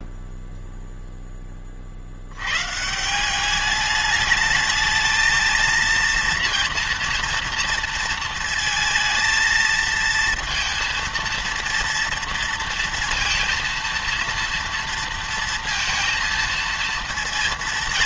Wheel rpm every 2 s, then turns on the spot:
0, 140, 210, 230, 230, 230, 230, 230, 230.
none